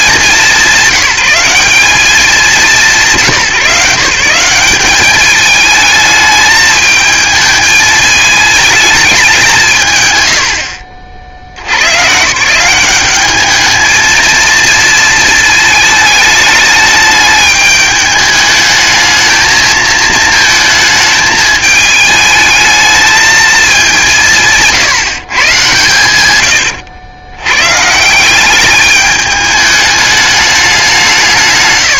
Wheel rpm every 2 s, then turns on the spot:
190, 170, 180, 220, 210, 70, 160, 220, 210, 220, 220, 220, 160, 90, 200, 200.
26-28